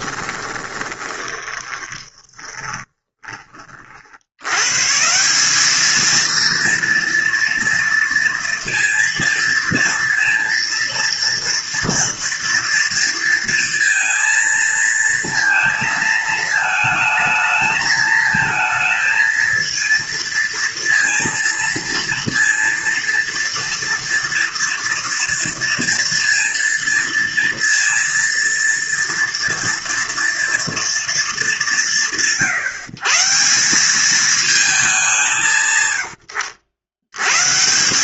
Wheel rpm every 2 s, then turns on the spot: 20, 20, 120, 230, 230, 230, 230, 230, 220, 220, 230, 230, 230, 230, 230, 230, 150, 210, 80.
0-4